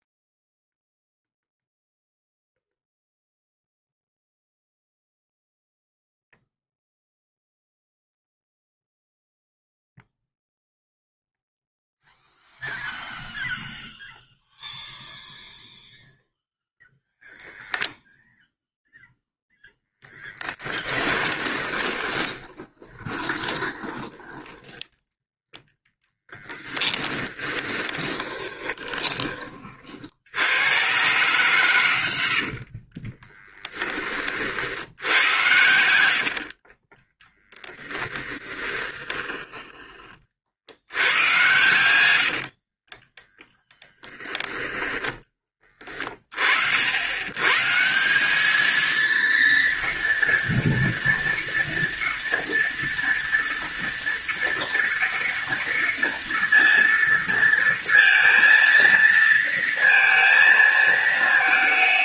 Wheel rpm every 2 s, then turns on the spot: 0, 0, 0, 0, 0, 0, 0, 0, 0, 0, 10, 20, 10, 10, 20, 110, 60, 70, 30, 10, 80, 40, 10, 70, 220, 230, 230, 230, 230, 230, 220.
20-24 26-30 32-34 38-40